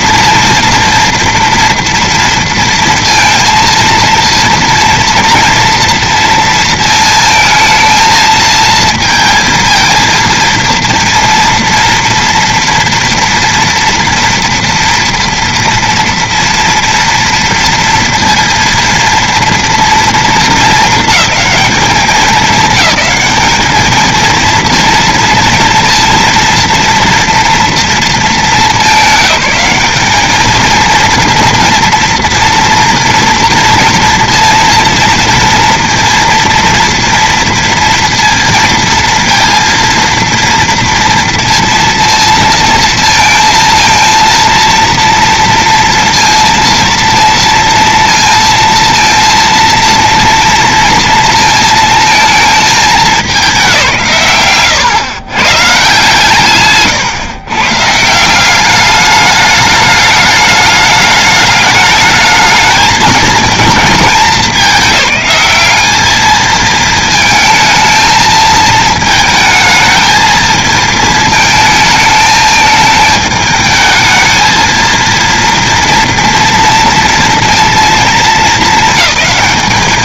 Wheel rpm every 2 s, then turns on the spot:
240, 230, 230, 230, 230, 230, 230, 230, 230, 230, 220, 210, 230, 230, 220, 220, 230, 230, 230, 230, 230, 230, 230, 230, 230, 230, 220, 140, 130, 180, 210, 220, 210, 220, 220, 220, 220, 220, 230, 230.
none